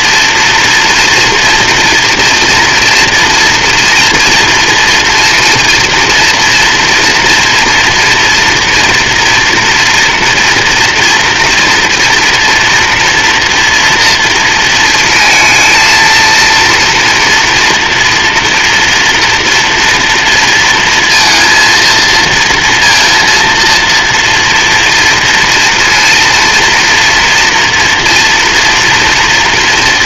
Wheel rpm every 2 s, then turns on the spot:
230, 230, 240, 230, 240, 240, 230, 230, 230, 230, 230, 230, 230, 230, 240.
none